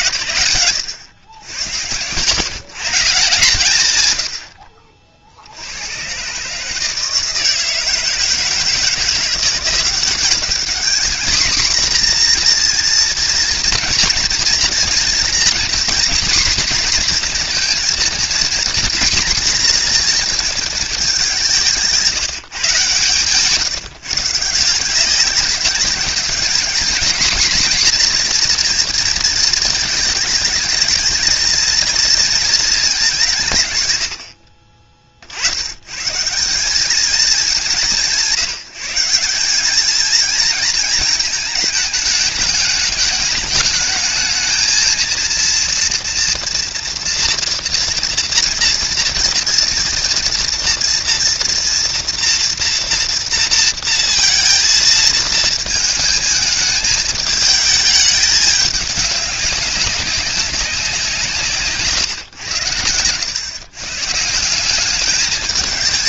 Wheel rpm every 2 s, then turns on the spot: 80, 150, 30, 150, 160, 210, 240, 230, 240, 220, 220, 140, 170, 210, 240, 220, 210, 20, 180, 170, 220, 210, 220, 230, 230, 230, 230, 230, 220, 210, 190, 100, 190.
none